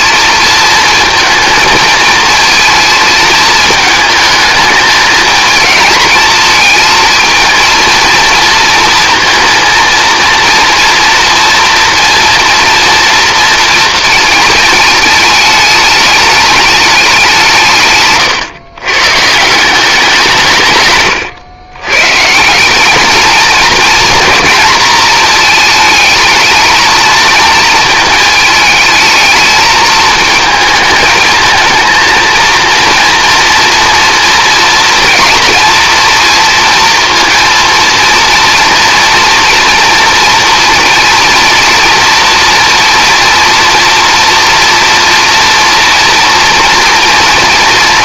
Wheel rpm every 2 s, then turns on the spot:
230, 230, 220, 220, 230, 230, 230, 220, 210, 130, 140, 180, 230, 220, 220, 220, 230, 230, 230, 230, 240, 230, 230, 230.
none